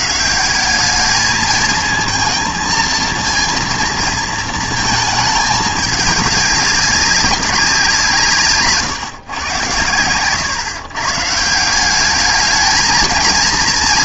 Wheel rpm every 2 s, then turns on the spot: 190, 230, 220, 200, 150, 130, 220.
none